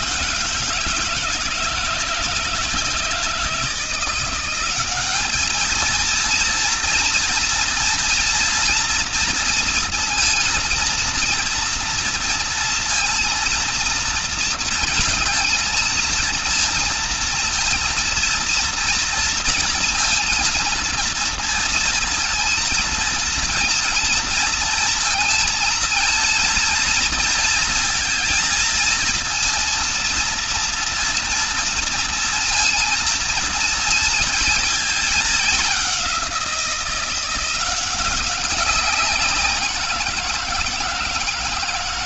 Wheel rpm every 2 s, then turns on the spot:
160, 160, 190, 230, 240, 230, 230, 230, 230, 230, 230, 230, 230, 230, 230, 230, 230, 220, 180, 190, 170.
none